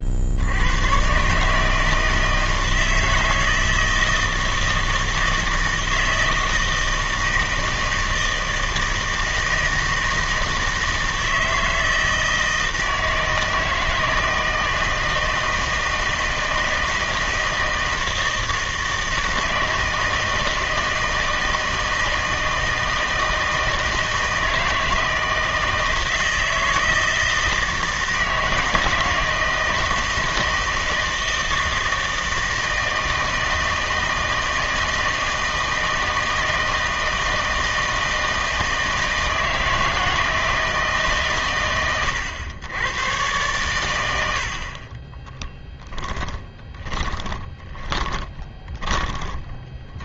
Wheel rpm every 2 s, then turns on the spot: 90, 160, 160, 160, 160, 160, 160, 160, 160, 160, 160, 160, 160, 160, 160, 160, 160, 160, 160, 160, 160, 90, 60, 20, 20.
46-50